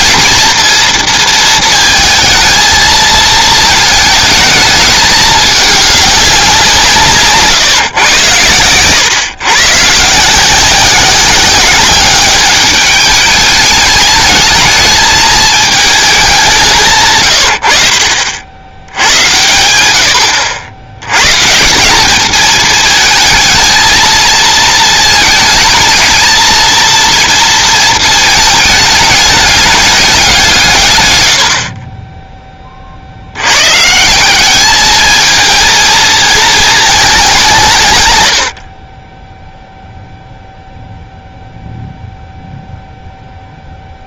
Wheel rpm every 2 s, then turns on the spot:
230, 230, 220, 180, 110, 170, 200, 220, 170, 80, 90, 220, 230, 230, 210, 150, 30, 210, 220, 50, 0, 0.
none